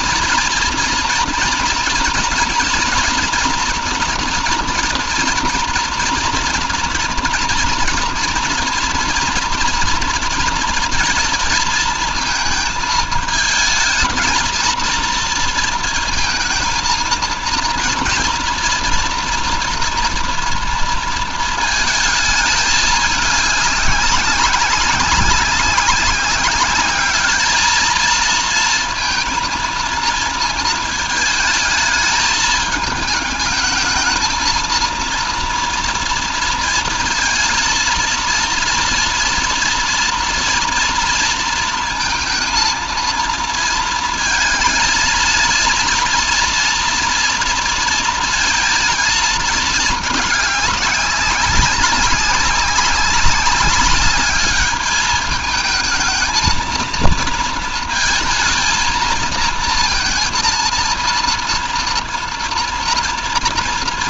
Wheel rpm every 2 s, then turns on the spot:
230, 230, 240, 230, 240, 230, 220, 230, 220, 230, 230, 210, 190, 200, 230, 220, 220, 230, 230, 230, 230, 230, 230, 230, 220, 210, 190, 210, 220, 230, 230, 230.
none